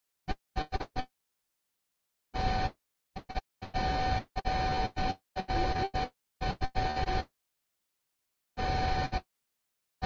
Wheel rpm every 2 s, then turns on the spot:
0, 0, 0, 0, 0.
none